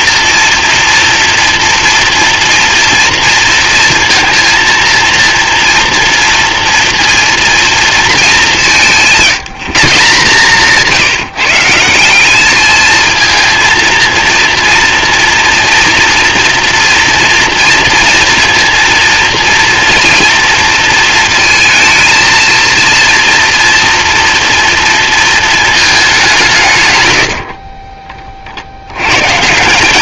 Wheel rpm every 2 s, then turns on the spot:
230, 230, 230, 230, 190, 160, 210, 230, 230, 230, 230, 230, 230, 140, 80.
10-12